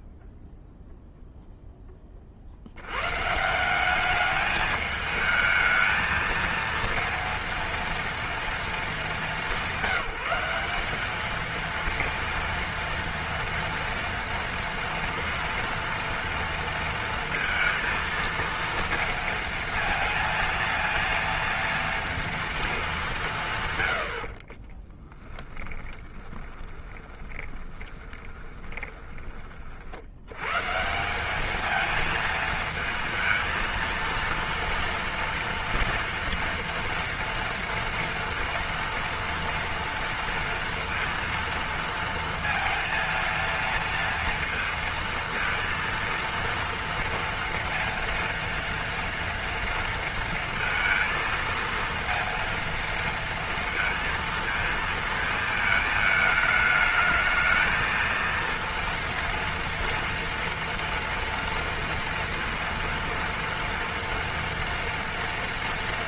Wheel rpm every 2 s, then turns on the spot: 0, 70, 210, 230, 220, 200, 230, 230, 230, 230, 230, 220, 40, 30, 20, 130, 220, 230, 230, 230, 230, 230, 230, 230, 230, 230, 230, 230, 220, 230, 230, 230, 230.
24-30